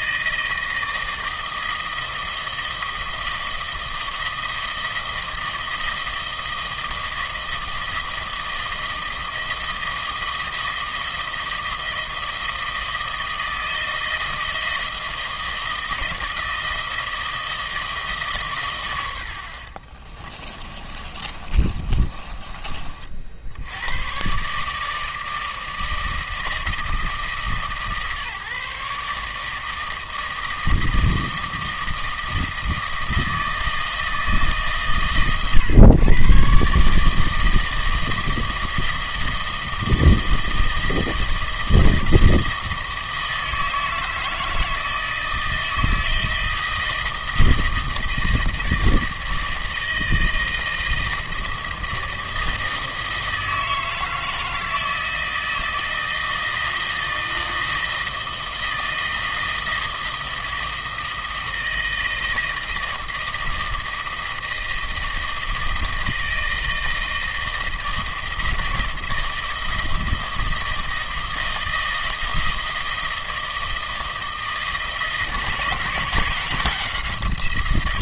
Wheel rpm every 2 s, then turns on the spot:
160, 160, 160, 160, 160, 160, 160, 160, 160, 120, 30, 40, 150, 160, 140, 160, 160, 140, 140, 160, 160, 160, 160, 160, 160, 160, 160, 160, 160, 160, 160, 160, 160, 160, 160, 160, 160, 160, 170.
20-22